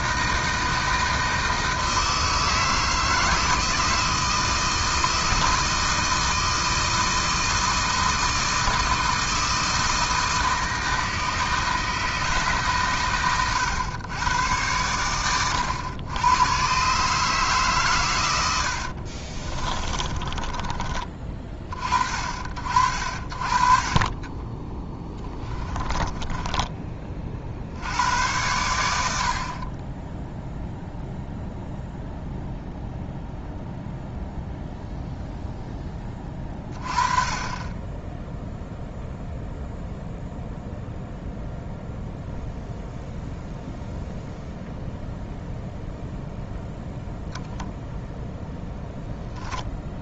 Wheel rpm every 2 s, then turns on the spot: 160, 160, 160, 160, 160, 160, 140, 100, 130, 70, 20, 40, 20, 20, 100, 0, 0, 0, 30, 0, 0, 0, 0, 0, 0.
18-22 24-26